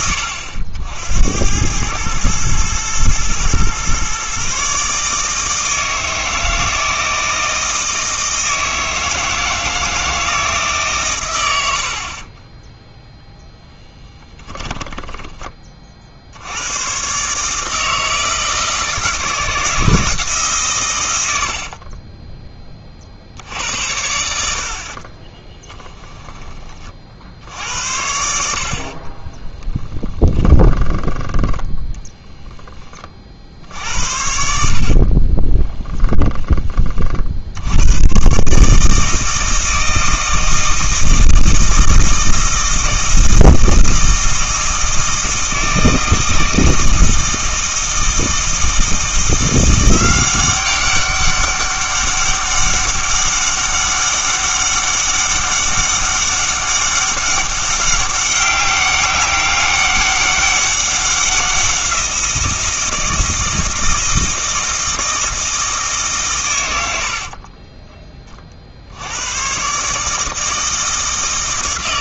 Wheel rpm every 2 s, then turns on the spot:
80, 110, 140, 160, 160, 140, 10, 10, 110, 160, 120, 30, 70, 30, 60, 20, 20, 50, 30, 150, 160, 160, 160, 160, 160, 190, 200, 200, 200, 200, 190, 170, 160, 80, 60, 160.
14-16 30-32 66-68